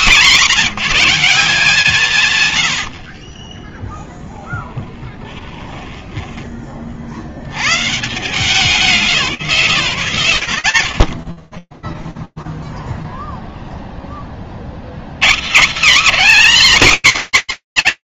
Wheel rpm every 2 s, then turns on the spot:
140, 160, 0, 10, 130, 160, 0, 30, 270.
6-8